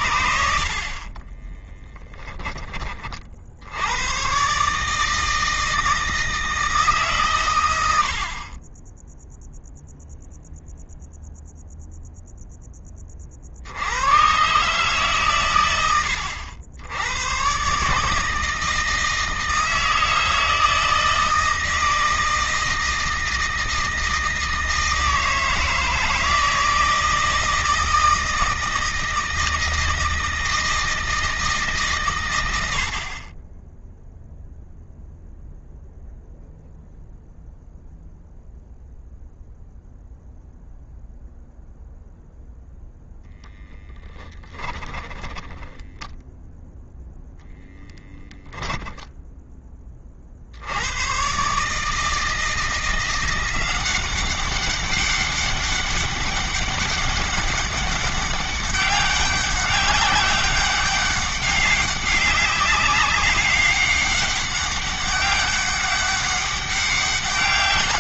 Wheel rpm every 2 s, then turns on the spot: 40, 40, 150, 140, 10, 0, 30, 130, 100, 160, 160, 160, 160, 160, 160, 160, 50, 0, 0, 0, 0, 0, 10, 0, 10, 110, 170, 200, 200, 190, 200, 190, 200, 200.
0-2 44-46